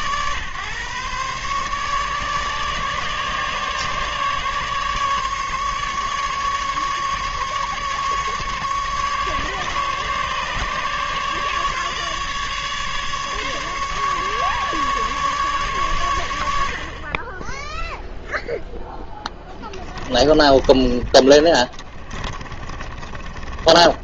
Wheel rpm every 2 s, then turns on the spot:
130, 150, 150, 150, 150, 150, 150, 150, 70, 0, 20, 30.
20-24